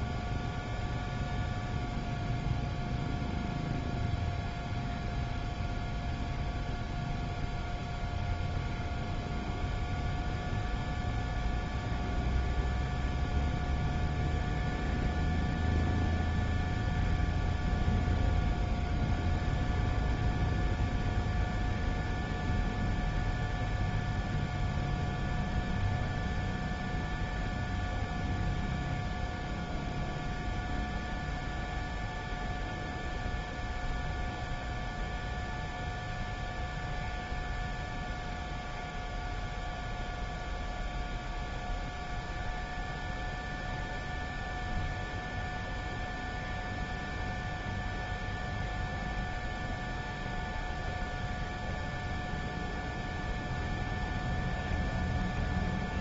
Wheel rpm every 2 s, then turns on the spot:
0, 0, 0, 0, 0, 0, 0, 0, 0, 0, 0, 0, 0, 0, 0, 0, 0, 0, 0, 0, 0, 0, 0, 0, 0, 0, 0, 0.
none